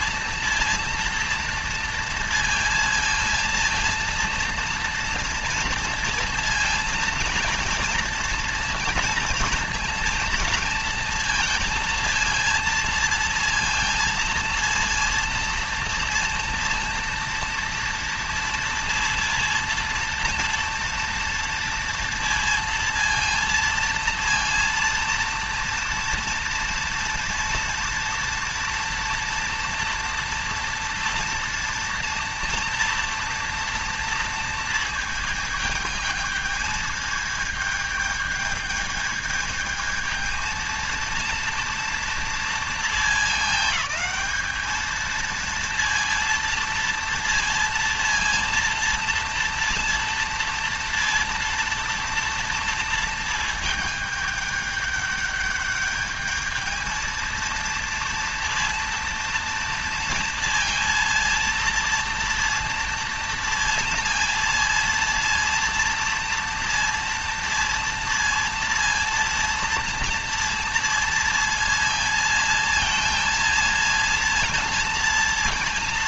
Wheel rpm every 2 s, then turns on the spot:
230, 230, 230, 230, 230, 230, 230, 230, 230, 230, 230, 230, 230, 230, 230, 230, 230, 220, 220, 220, 230, 230, 220, 230, 230, 230, 230, 210, 220, 230, 230, 230, 230, 230, 230, 230, 230, 230.
none